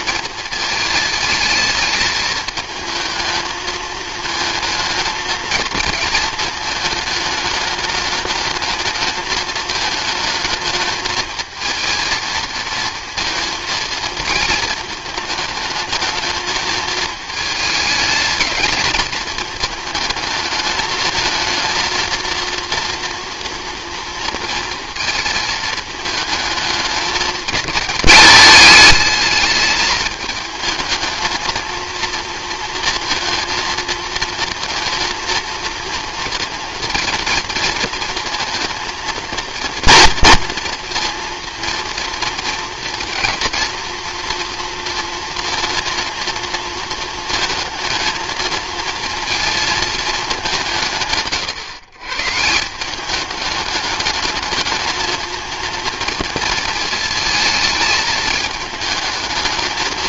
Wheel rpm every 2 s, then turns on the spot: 220, 220, 220, 220, 220, 220, 230, 220, 220, 220, 220, 240, 230, 210, 210, 220, 230, 230, 230, 230, 230, 230, 230, 220, 220, 110, 170, 220, 230, 220.
none